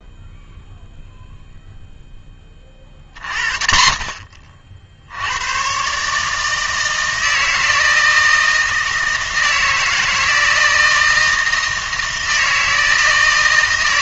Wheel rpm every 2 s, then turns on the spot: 0, 30, 50, 160, 160, 160, 160.
none